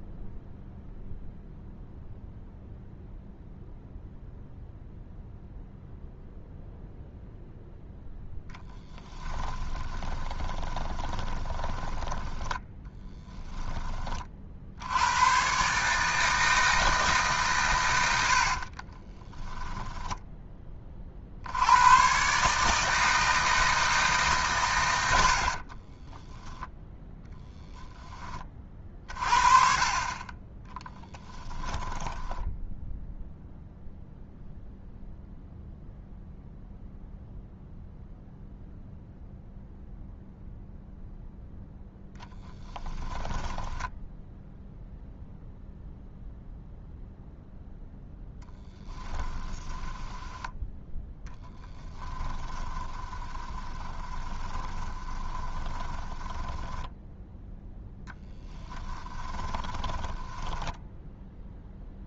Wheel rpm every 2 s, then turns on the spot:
0, 0, 0, 0, 10, 20, 10, 80, 160, 40, 30, 150, 120, 10, 40, 10, 0, 0, 0, 0, 0, 10, 0, 0, 10, 10, 20, 30, 10, 10, 10.
8-14 18-20 30-32 42-44 48-50 52-60